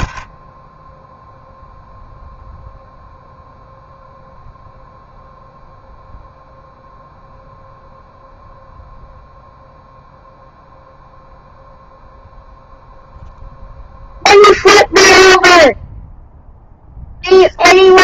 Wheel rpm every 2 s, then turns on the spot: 30, 0, 0, 0, 0, 0, 0, 0, 0.
0-2